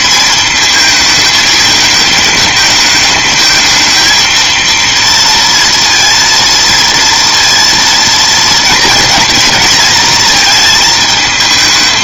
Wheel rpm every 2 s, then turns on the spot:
220, 220, 230, 230, 230, 220.
none